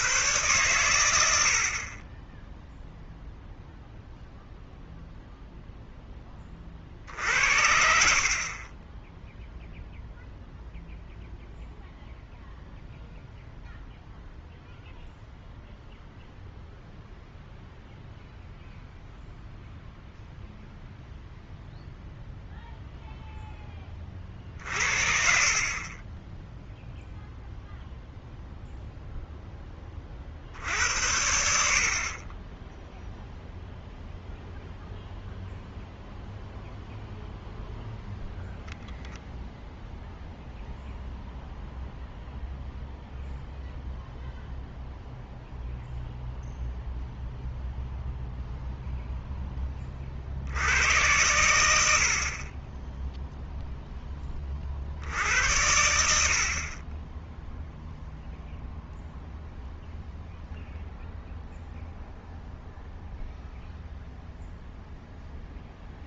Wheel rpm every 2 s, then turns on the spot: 120, 10, 0, 30, 30, 0, 0, 0, 0, 0, 0, 0, 40, 0, 0, 70, 10, 0, 0, 0, 0, 0, 0, 0, 0, 80, 30, 40, 30, 0, 0, 0, 0.
none